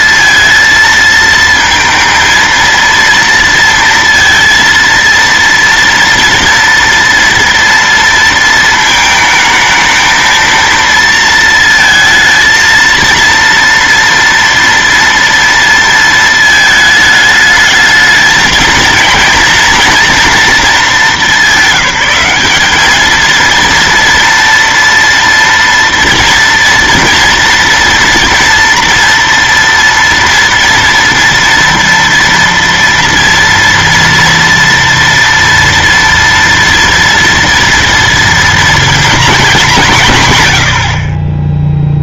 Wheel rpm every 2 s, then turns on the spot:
230, 230, 230, 230, 230, 230, 230, 230, 220, 220, 220, 200, 230, 230, 230, 230, 230, 230, 230, 230, 90.
none